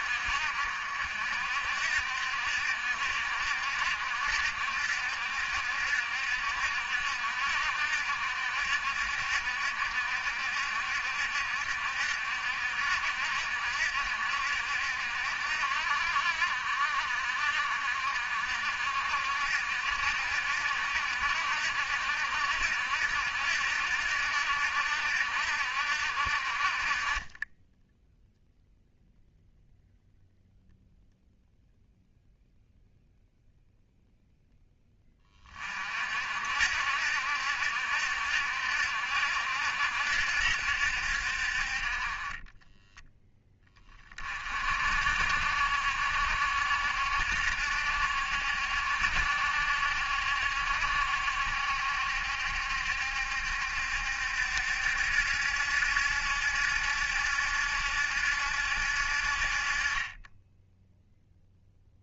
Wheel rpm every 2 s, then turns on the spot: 60, 70, 70, 70, 70, 70, 70, 70, 60, 60, 70, 70, 70, 40, 0, 0, 0, 10, 70, 70, 70, 20, 60, 70, 70, 70, 70, 70, 70, 70, 10.
42-44